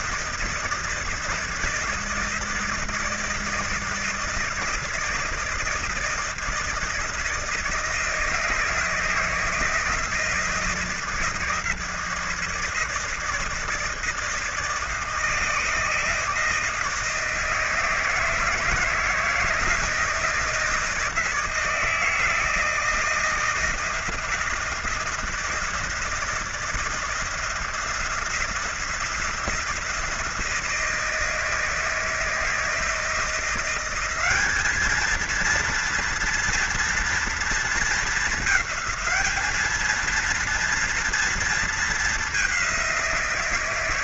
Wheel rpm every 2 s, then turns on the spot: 160, 160, 160, 160, 160, 160, 160, 160, 160, 160, 160, 160, 170, 160, 170, 160, 160, 220, 230, 210, 230, 180.
none